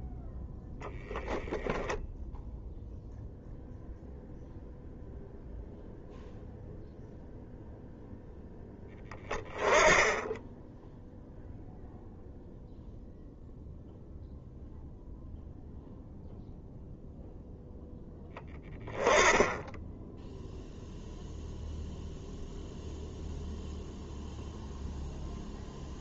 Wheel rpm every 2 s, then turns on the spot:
0, 0, 0, 0, 0, 10, 0, 0, 0, 10, 0, 0, 0.
none